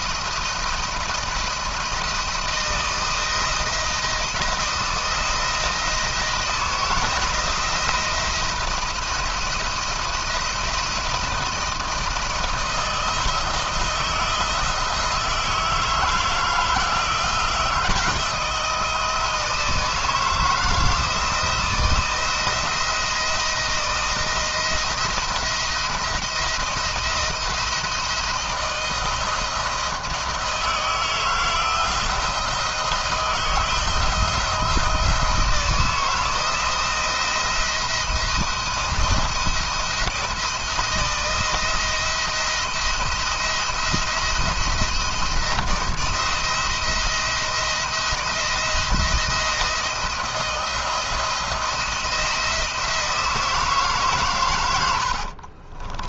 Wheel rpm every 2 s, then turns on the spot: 170, 160, 170, 160, 170, 170, 170, 170, 170, 170, 160, 170, 170, 170, 160, 160, 160, 170, 160, 160, 160, 170, 170, 170, 170, 170, 160, 90.
54-56